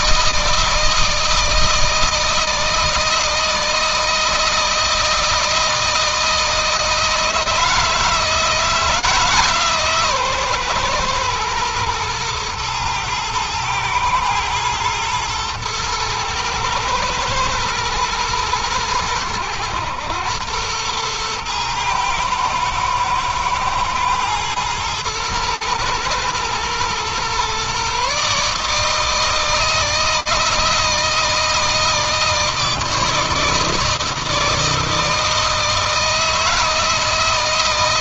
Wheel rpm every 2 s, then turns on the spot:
160, 160, 160, 160, 160, 140, 120, 110, 110, 110, 100, 110, 110, 120, 150, 160, 160, 160, 160.
none